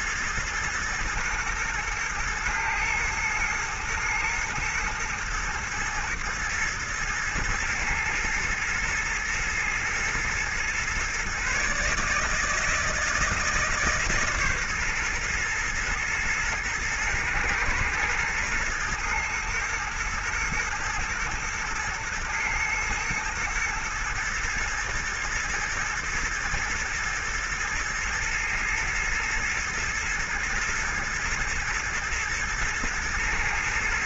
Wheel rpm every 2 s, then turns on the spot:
120, 110, 110, 120, 110, 130, 160, 130, 110, 120, 110, 120, 110, 120, 110, 120, 110.
none